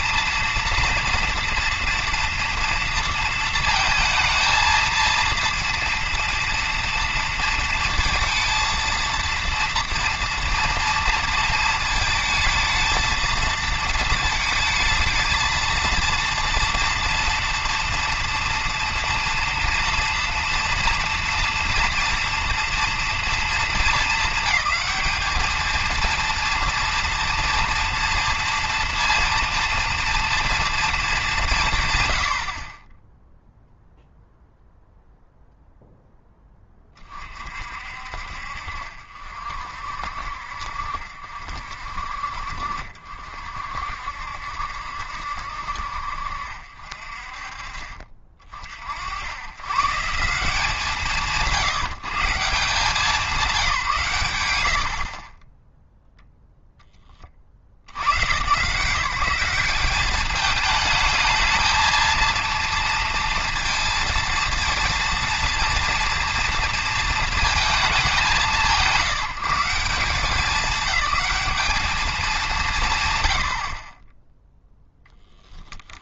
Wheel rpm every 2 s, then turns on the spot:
230, 230, 230, 230, 230, 230, 220, 220, 230, 230, 230, 230, 210, 230, 230, 220, 10, 0, 20, 50, 60, 50, 70, 40, 70, 140, 180, 60, 20, 160, 220, 230, 230, 230, 160, 210, 150, 0.
54-56